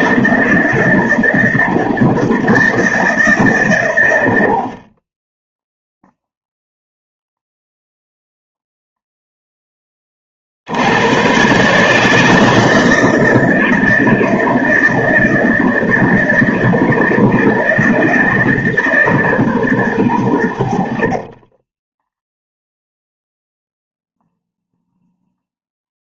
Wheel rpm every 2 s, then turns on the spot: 160, 160, 40, 0, 0, 80, 160, 160, 160, 150, 60, 0, 0.
none